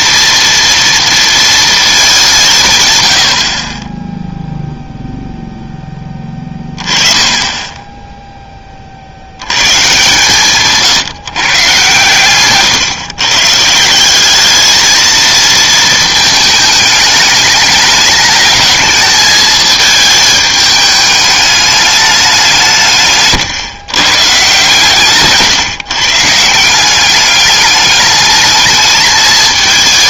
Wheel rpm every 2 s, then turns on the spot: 230, 140, 0, 20, 20, 150, 130, 220, 220, 210, 210, 160, 150, 180, 210.
none